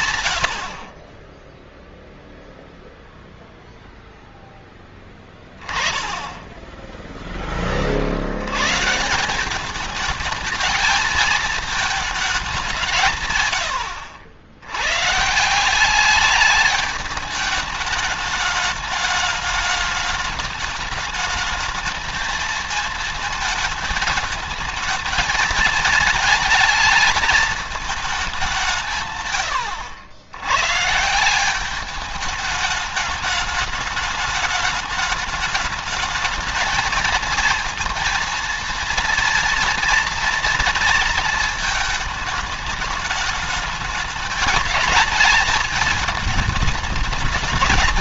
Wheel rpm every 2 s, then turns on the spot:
40, 0, 10, 10, 150, 220, 160, 120, 210, 210, 210, 220, 220, 220, 160, 140, 210, 210, 220, 230, 230, 210, 210, 220.
none